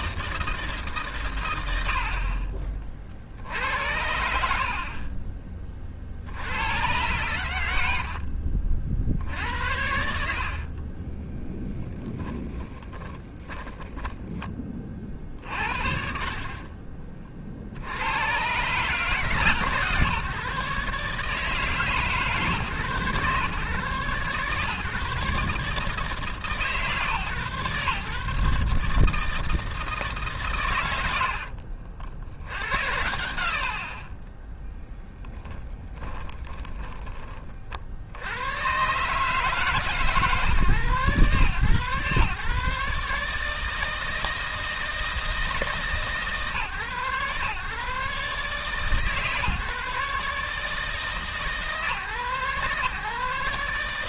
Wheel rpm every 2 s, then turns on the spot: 150, 40, 40, 90, 60, 40, 10, 30, 40, 140, 140, 120, 140, 140, 150, 110, 90, 10, 20, 120, 130, 140, 160, 130, 140, 150, 140.
10-14 16-18 34-36